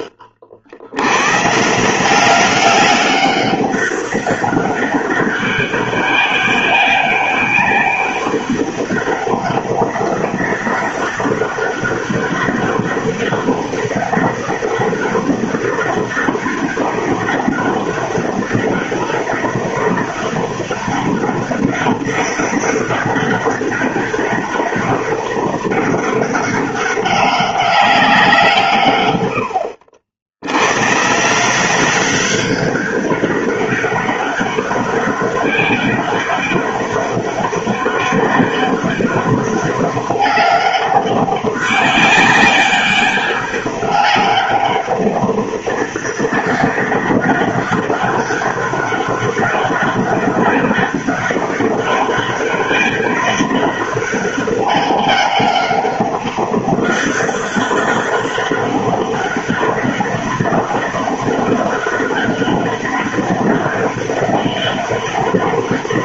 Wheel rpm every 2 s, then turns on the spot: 70, 200, 200, 200, 200, 200, 200, 200, 200, 200, 200, 200, 200, 200, 140, 120, 200, 200, 200, 200, 200, 200, 200, 200, 200, 200, 200, 200, 200, 200, 200, 200, 200.
none